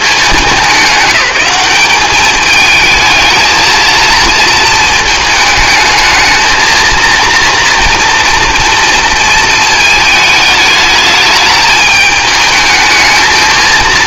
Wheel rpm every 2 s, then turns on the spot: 190, 220, 230, 230, 230, 210, 220.
none